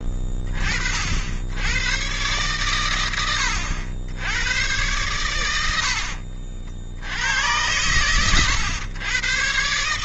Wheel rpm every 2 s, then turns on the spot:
50, 110, 100, 90, 110.
4-6